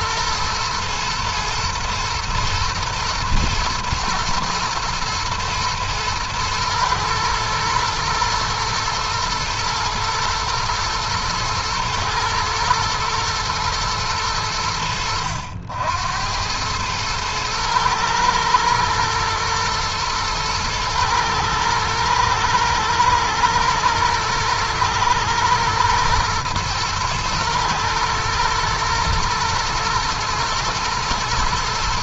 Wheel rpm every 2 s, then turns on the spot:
120, 120, 120, 110, 110, 120, 110, 70, 110, 120, 110, 110, 120, 110, 110, 120.
none